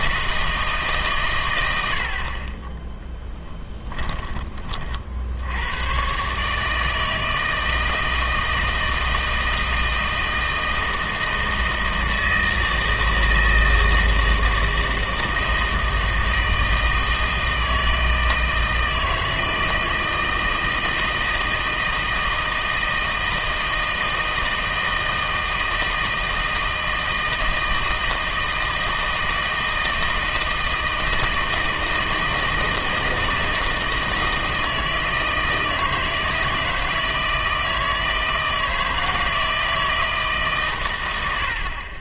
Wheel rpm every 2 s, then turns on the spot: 160, 20, 40, 150, 160, 160, 160, 160, 160, 160, 160, 160, 160, 160, 160, 160, 160, 160, 160, 160, 130.
none